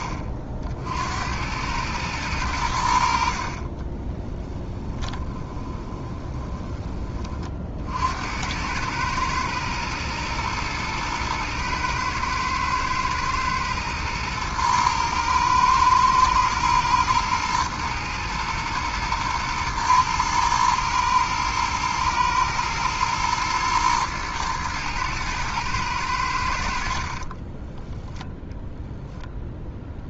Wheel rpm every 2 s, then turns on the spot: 60, 90, 10, 20, 100, 110, 110, 110, 110, 110, 110, 110, 110, 60, 0.
4-6